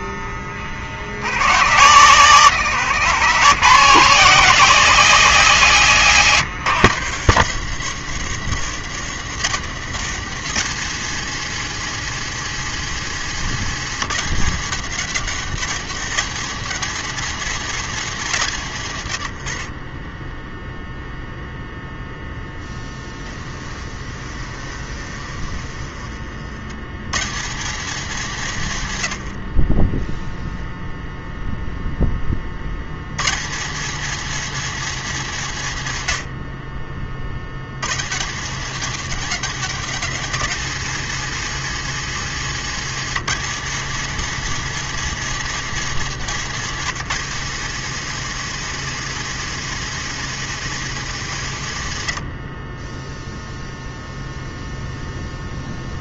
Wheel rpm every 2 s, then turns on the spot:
60, 140, 180, 140, 160, 200, 220, 190, 210, 150, 0, 10, 30, 100, 140, 0, 80, 220, 40, 190, 210, 210, 230, 210, 230, 220, 40, 0.
22-26